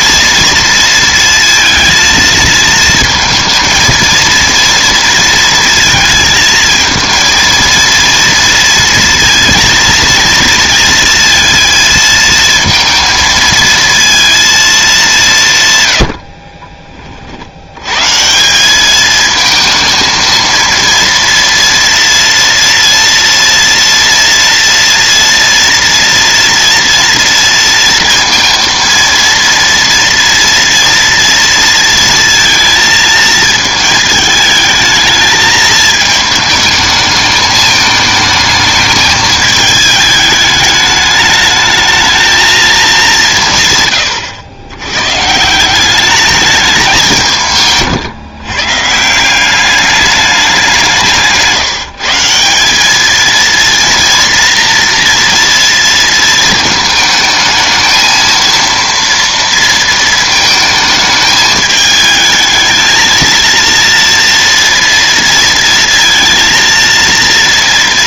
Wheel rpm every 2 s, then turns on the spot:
230, 230, 230, 230, 230, 230, 230, 210, 30, 200, 230, 230, 230, 230, 230, 230, 230, 220, 210, 220, 210, 210, 110, 190, 150, 180, 210, 230, 220, 230, 220, 220, 230, 230.
none